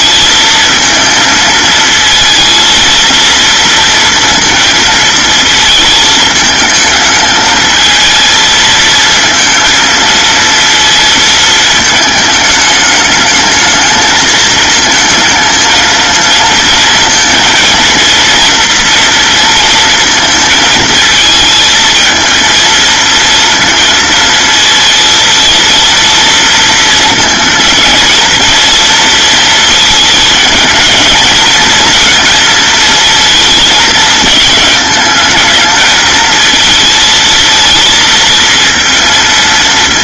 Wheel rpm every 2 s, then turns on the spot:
220, 230, 230, 220, 220, 230, 220, 220, 230, 230, 230, 230, 230, 230, 230, 220, 230, 220, 220, 230.
none